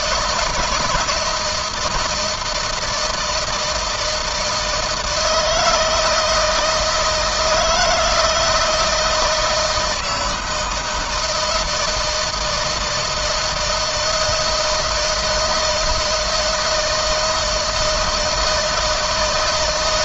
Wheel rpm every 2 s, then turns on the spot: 160, 160, 160, 160, 170, 160, 160, 160, 160, 160.
none